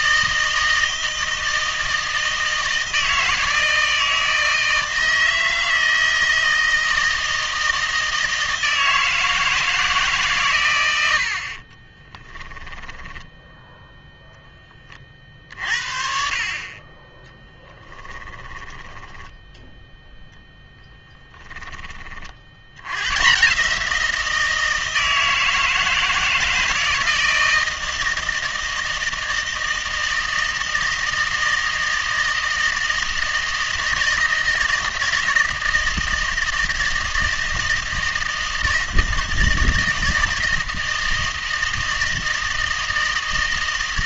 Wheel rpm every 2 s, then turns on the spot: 160, 160, 160, 160, 160, 110, 10, 20, 30, 20, 10, 80, 170, 160, 160, 160, 160, 160, 160, 160, 160, 160.
12-14 18-22